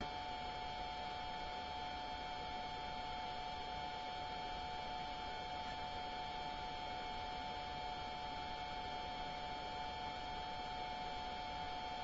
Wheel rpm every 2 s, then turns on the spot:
0, 0, 0, 0, 0, 0.
none